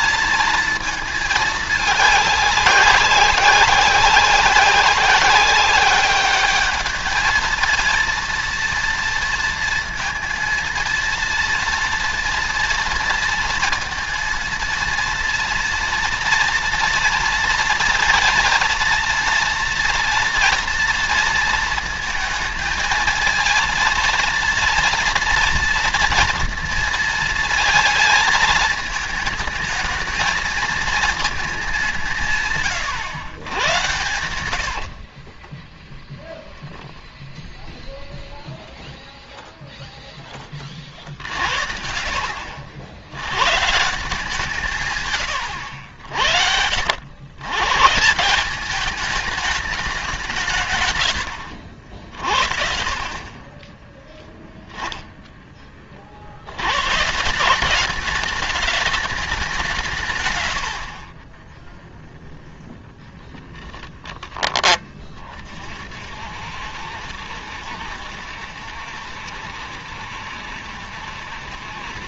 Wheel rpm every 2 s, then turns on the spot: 220, 200, 200, 220, 230, 230, 230, 230, 230, 230, 230, 230, 230, 230, 220, 230, 120, 60, 10, 0, 60, 90, 150, 90, 210, 130, 40, 0, 130, 210, 50, 0, 20, 60, 70, 70.
34-36 40-42 60-62